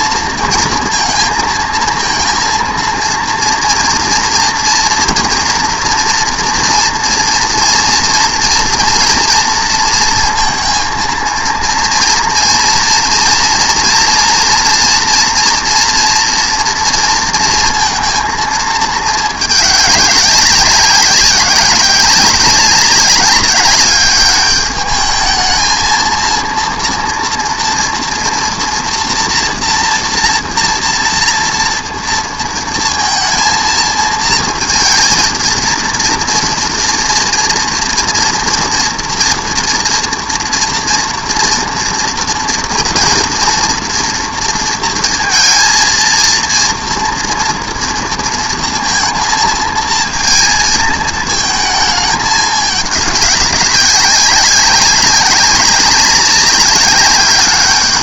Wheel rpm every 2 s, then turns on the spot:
230, 230, 230, 230, 230, 230, 230, 240, 230, 220, 190, 190, 210, 230, 240, 230, 230, 220, 230, 230, 230, 230, 230, 230, 230, 230, 210, 190, 200.
none